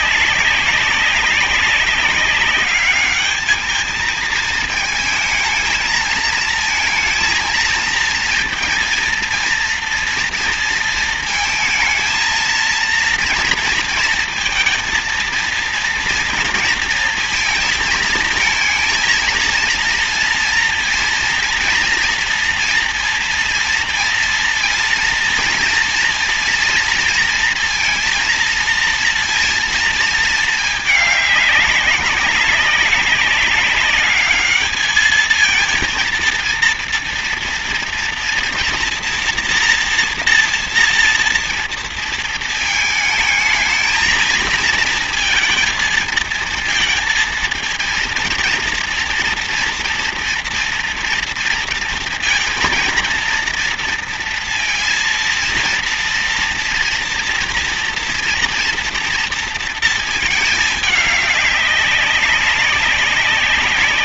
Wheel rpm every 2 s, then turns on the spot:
190, 200, 230, 230, 230, 230, 230, 230, 230, 220, 230, 230, 230, 230, 230, 220, 190, 210, 230, 230, 240, 220, 230, 230, 230, 240, 230, 230, 230, 240, 210, 200.
none